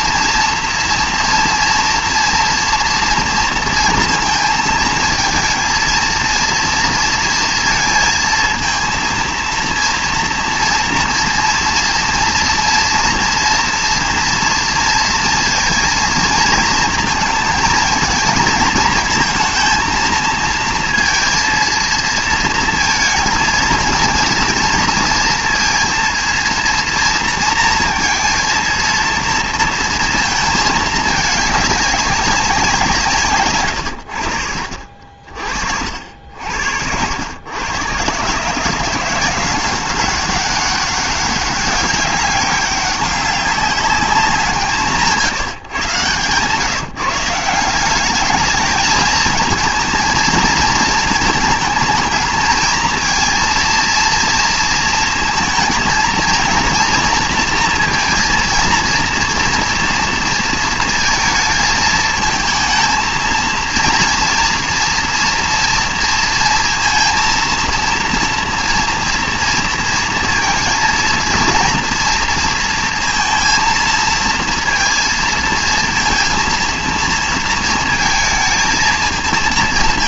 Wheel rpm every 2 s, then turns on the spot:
240, 230, 220, 230, 230, 230, 230, 230, 220, 220, 230, 230, 230, 230, 230, 220, 170, 50, 80, 160, 200, 200, 180, 160, 220, 220, 220, 230, 230, 230, 220, 220, 230, 230, 230, 230, 230, 230, 230, 220.
none